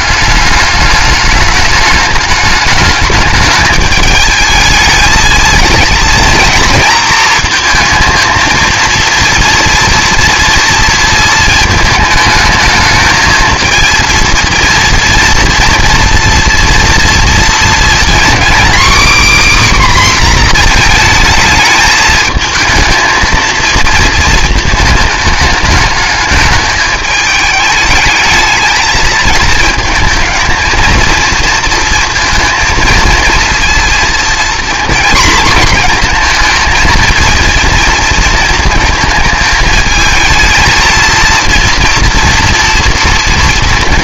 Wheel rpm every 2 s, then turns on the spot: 210, 210, 220, 230, 230, 230, 220, 230, 230, 270, 240, 220, 220, 210, 220, 230, 230, 240, 230, 230, 220, 230.
none